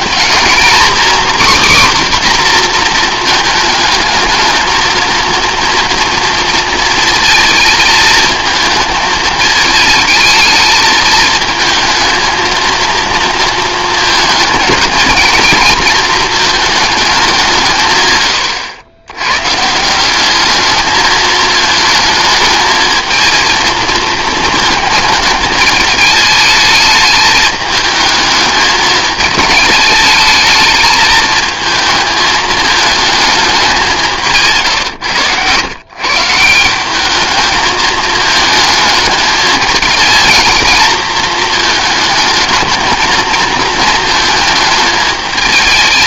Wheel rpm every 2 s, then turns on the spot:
250, 230, 230, 230, 220, 220, 230, 230, 210, 110, 220, 220, 220, 210, 220, 220, 220, 110, 190, 220, 230, 220, 220.
none